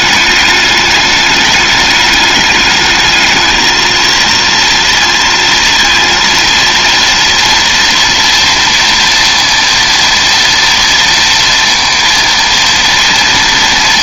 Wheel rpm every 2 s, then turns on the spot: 210, 220, 230, 230, 230, 230, 230.
none